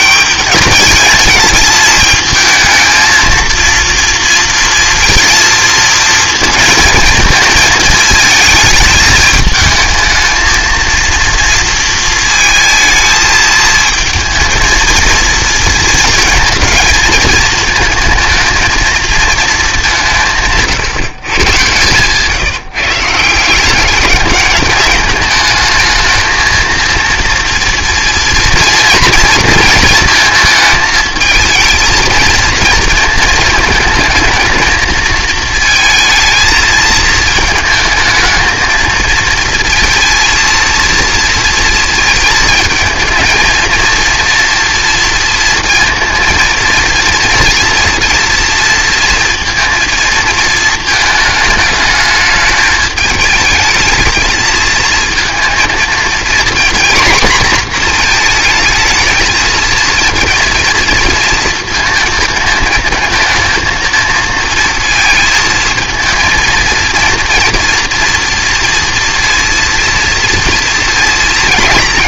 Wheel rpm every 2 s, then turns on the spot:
220, 220, 230, 230, 220, 220, 220, 230, 220, 220, 160, 160, 200, 230, 240, 220, 220, 220, 220, 220, 230, 220, 230, 230, 230, 230, 210, 230, 240, 230, 230, 220, 230, 230, 230, 230.
none